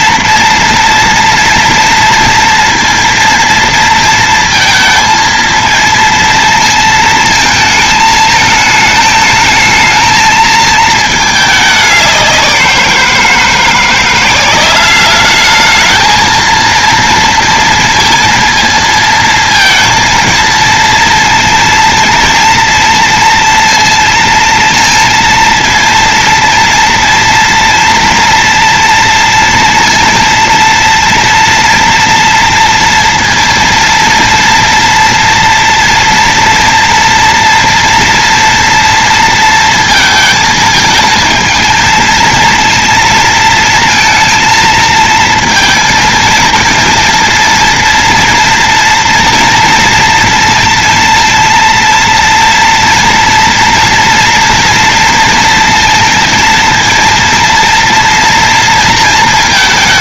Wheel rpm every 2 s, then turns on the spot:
230, 230, 220, 220, 220, 220, 180, 190, 230, 220, 230, 230, 230, 230, 230, 230, 230, 230, 230, 230, 220, 230, 230, 230, 230, 230, 230, 230, 230, 230.
none